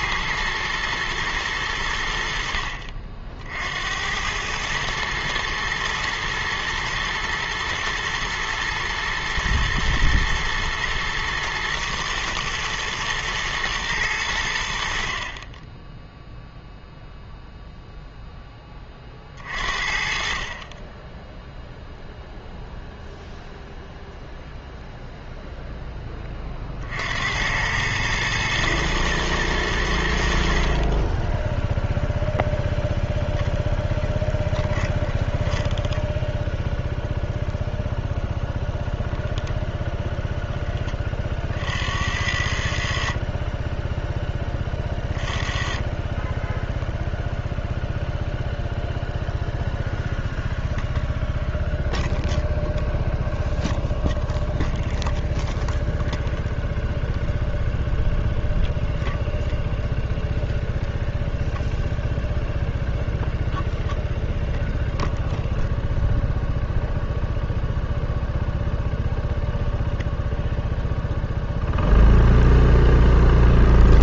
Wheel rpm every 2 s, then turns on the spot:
120, 60, 110, 120, 120, 110, 120, 70, 0, 20, 30, 0, 0, 40, 110, 50, 0, 10, 0, 0, 10, 70, 20, 10, 0, 0, 0, 0, 0, 0, 0, 0, 0, 0, 0, 0, 0.
34-36